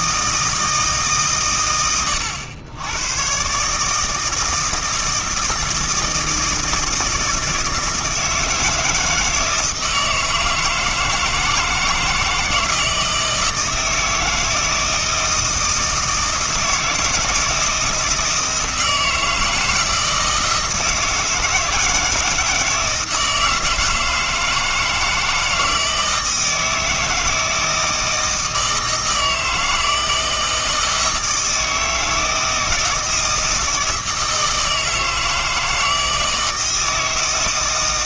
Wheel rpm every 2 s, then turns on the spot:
160, 100, 160, 160, 160, 160, 160, 160, 160, 160, 160, 160, 160, 160, 160, 160, 160, 160, 160.
none